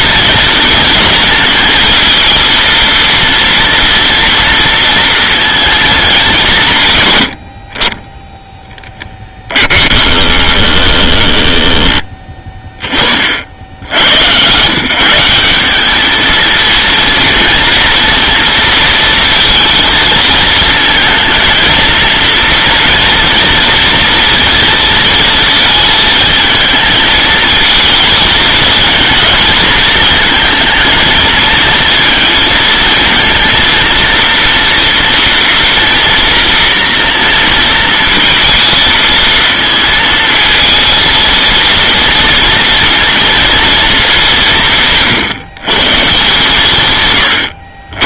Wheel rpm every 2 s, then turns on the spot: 230, 230, 230, 170, 10, 10, 20, 120, 230, 230, 220, 230, 230, 220, 230, 220, 220, 230, 230, 230, 230, 230, 180, 140.
10-12